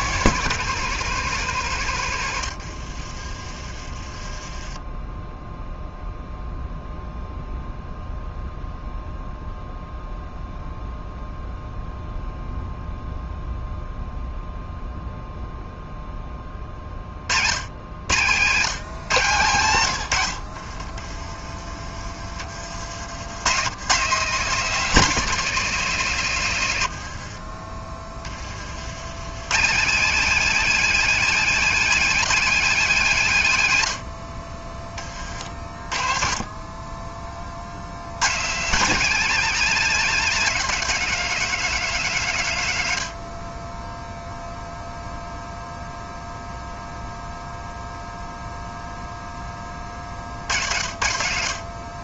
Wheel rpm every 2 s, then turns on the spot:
160, 50, 10, 0, 0, 0, 0, 0, 40, 130, 40, 70, 220, 90, 90, 220, 210, 30, 20, 180, 180, 90, 0, 0, 0, 70.
2-4 20-22 26-28